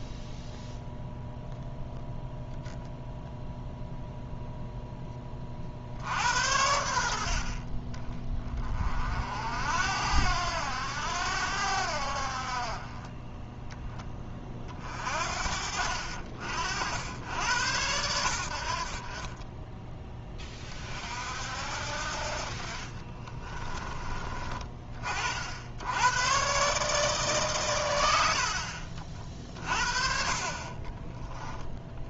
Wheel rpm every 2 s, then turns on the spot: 0, 0, 10, 80, 40, 90, 30, 40, 80, 50, 40, 40, 40, 140, 40, 30.
22-24 30-32